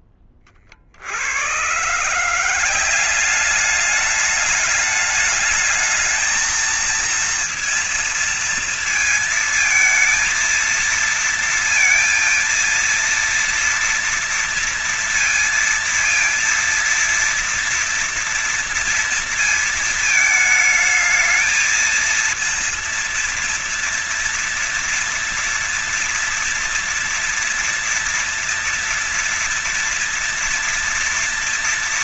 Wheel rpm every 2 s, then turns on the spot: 20, 160, 210, 220, 230, 230, 230, 230, 230, 230, 220, 230, 230, 230, 230, 230.
none